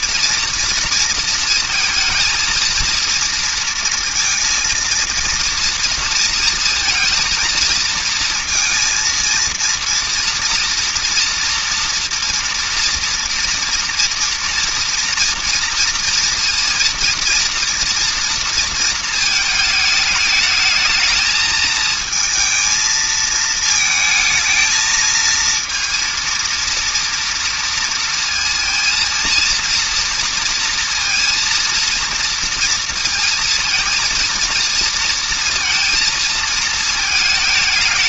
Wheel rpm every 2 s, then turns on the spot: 240, 230, 230, 230, 230, 230, 230, 230, 230, 230, 220, 220, 220, 230, 230, 230, 230, 230, 230.
none